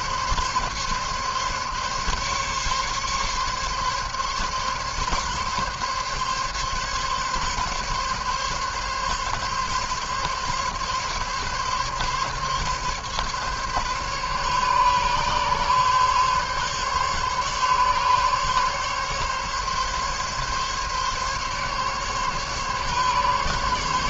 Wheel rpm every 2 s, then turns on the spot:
140, 140, 140, 140, 140, 140, 140, 140, 140, 140, 140, 140.
none